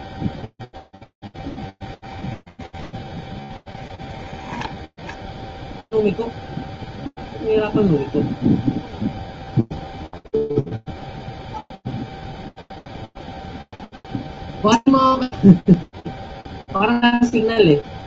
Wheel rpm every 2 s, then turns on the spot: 0, 0, 0, 0, 0, 0, 0, 0, 0.
none